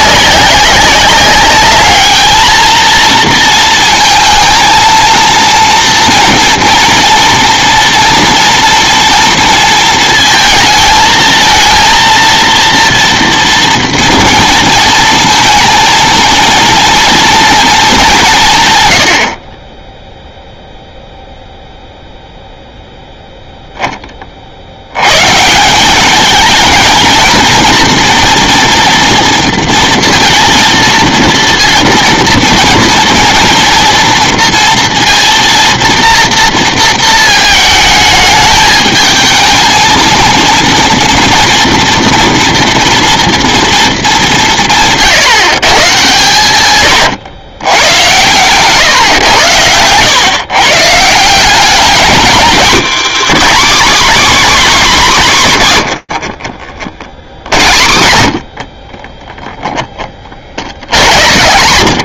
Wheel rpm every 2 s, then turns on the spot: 190, 220, 230, 230, 240, 230, 230, 230, 230, 130, 0, 0, 70, 220, 240, 230, 230, 230, 230, 210, 230, 230, 170, 120, 130, 140, 250, 260, 70, 40, 70.
18-20 58-60